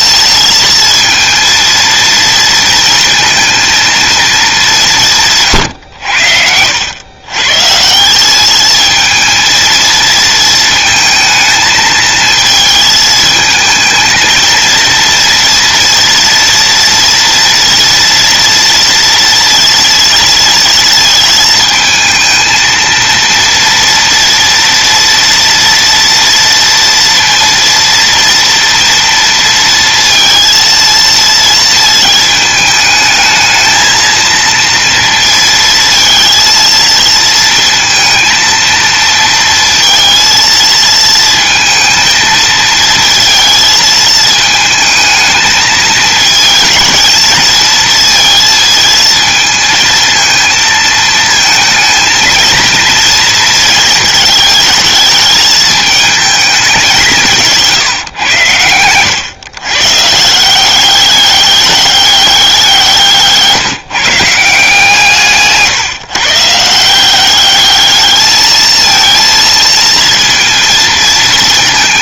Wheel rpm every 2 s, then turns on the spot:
230, 230, 170, 110, 220, 230, 220, 230, 230, 230, 230, 230, 230, 230, 230, 230, 220, 230, 230, 230, 230, 230, 220, 220, 220, 220, 230, 220, 200, 110, 200, 170, 160, 180, 230, 230.
none